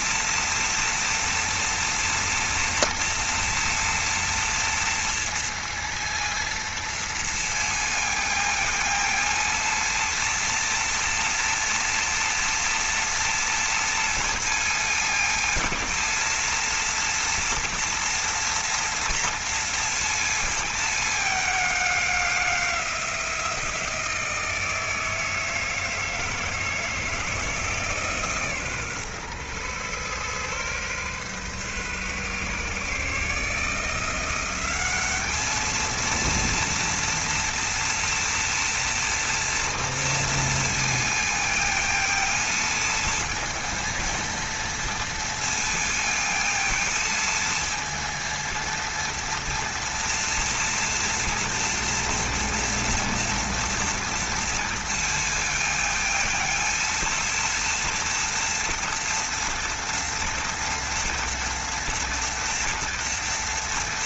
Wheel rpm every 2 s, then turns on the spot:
230, 230, 230, 230, 220, 230, 230, 230, 230, 230, 210, 180, 160, 160, 130, 130, 150, 200, 230, 230, 220, 230, 230, 230, 230, 230, 230, 230, 230, 230, 230, 230.
none